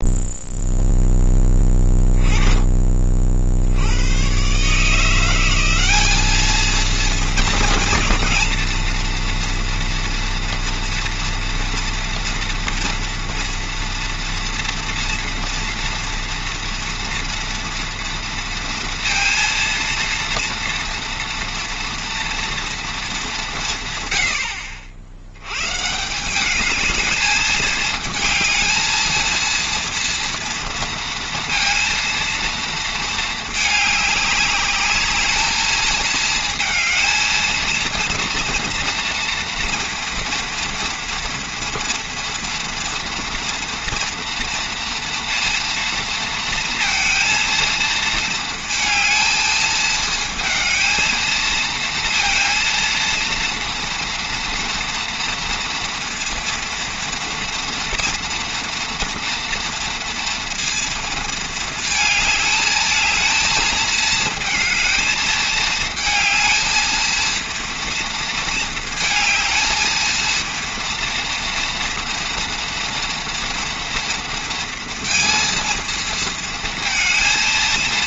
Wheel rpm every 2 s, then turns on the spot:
0, 20, 150, 220, 230, 230, 230, 230, 230, 230, 230, 230, 80, 200, 220, 230, 230, 210, 220, 230, 230, 230, 230, 230, 230, 220, 230, 240, 230, 230, 230, 220, 220, 220, 230, 230, 240, 230, 230.
none